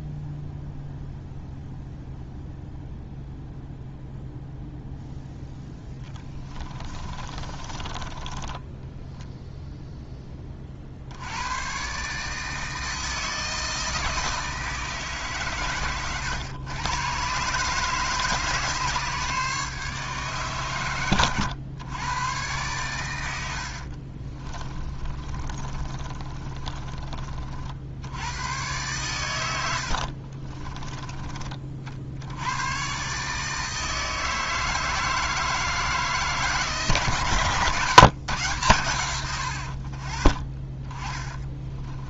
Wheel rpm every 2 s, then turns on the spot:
0, 0, 0, 30, 10, 50, 160, 160, 120, 150, 120, 110, 30, 30, 110, 10, 120, 160, 150, 130, 20.
6-10 24-28 40-42